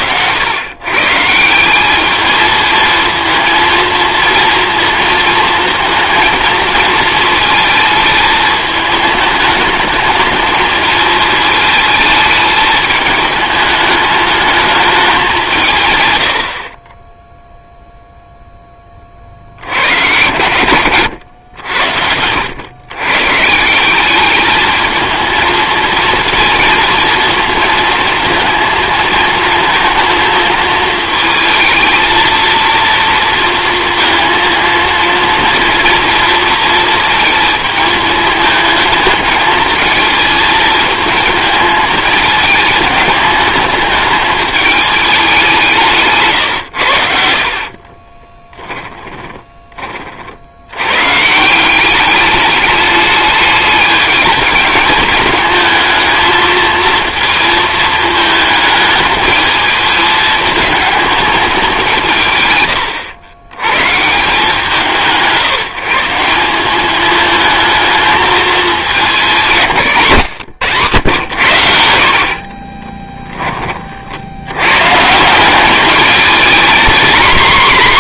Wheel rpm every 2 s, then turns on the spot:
120, 220, 230, 220, 210, 220, 210, 210, 40, 10, 110, 110, 220, 220, 220, 220, 230, 230, 230, 220, 220, 210, 210, 100, 10, 100, 210, 210, 230, 210, 220, 110, 170, 200, 210, 130, 30, 120, 230.
48-50 72-74